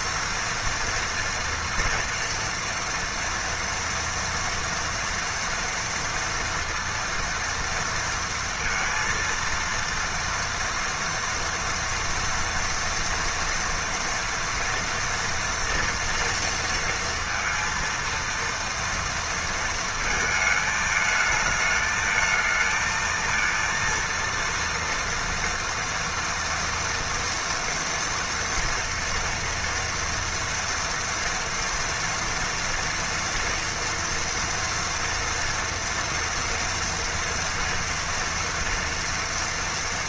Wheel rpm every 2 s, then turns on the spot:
230, 230, 230, 230, 230, 230, 230, 230, 230, 230, 220, 220, 230, 230, 230, 230, 230, 230, 240, 230.
none